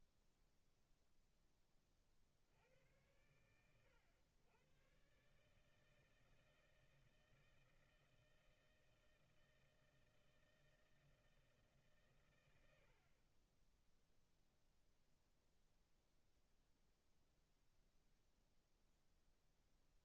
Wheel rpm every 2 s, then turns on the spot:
0, 70, 110, 160, 160, 160, 110, 0, 0, 0.
none